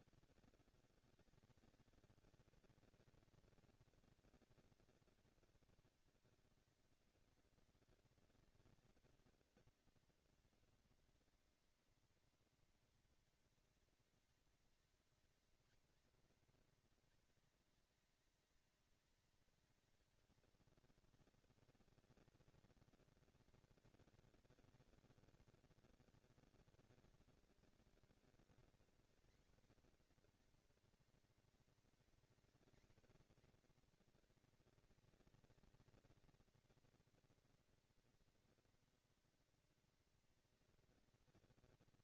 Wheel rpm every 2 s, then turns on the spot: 190, 220, 220, 230, 240, 230, 230, 220, 220, 210, 220, 220, 220, 220, 240, 240, 240, 220, 220, 230, 230.
none